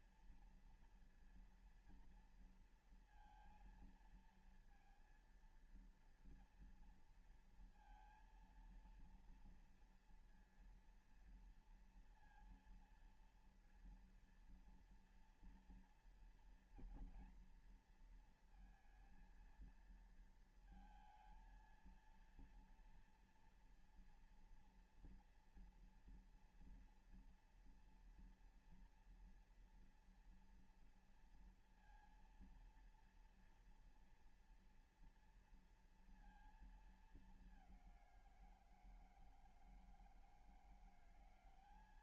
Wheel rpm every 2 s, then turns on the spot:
230, 230, 230, 230, 230, 230, 230, 230, 230, 230, 230, 230, 230, 240, 230, 230, 230, 230, 230, 170, 170.
none